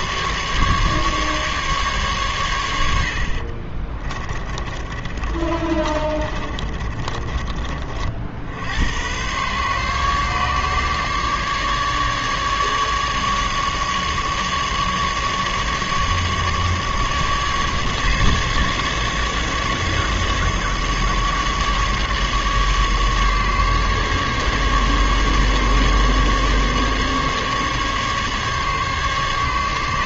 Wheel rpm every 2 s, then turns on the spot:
140, 90, 30, 30, 80, 140, 150, 150, 140, 140, 150, 150, 140, 140, 140.
4-8